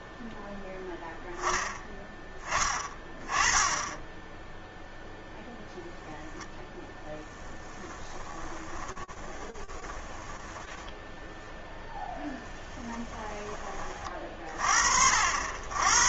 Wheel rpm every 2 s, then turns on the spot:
0, 20, 0, 0, 20, 10, 10, 50.
8-12